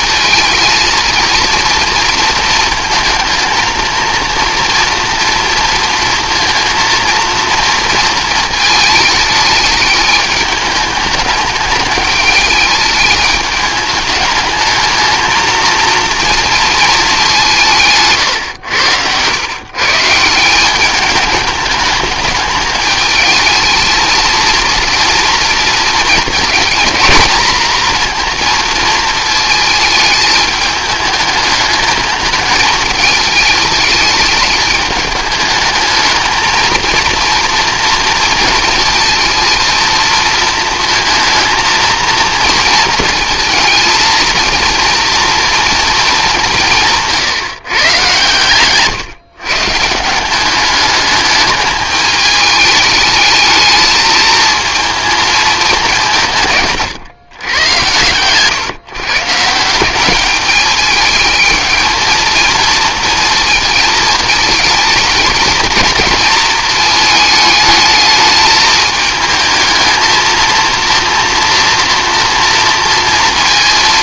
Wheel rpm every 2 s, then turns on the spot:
230, 230, 240, 230, 220, 210, 210, 210, 220, 110, 190, 220, 230, 220, 230, 210, 220, 210, 230, 230, 230, 230, 230, 170, 130, 210, 210, 230, 140, 140, 210, 230, 220, 220, 220, 230, 230.
18-20